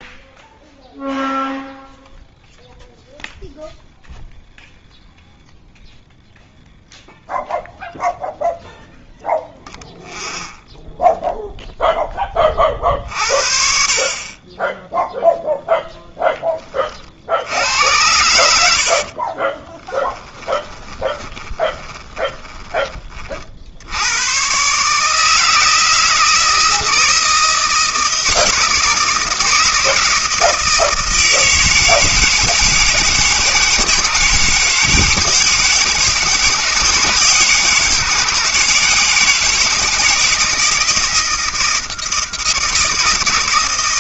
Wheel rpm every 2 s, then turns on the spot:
0, 0, 0, 0, 0, 0, 40, 0, 40, 50, 20, 30, 140, 160, 160, 160, 160, 160, 160, 160, 160, 160.
18-22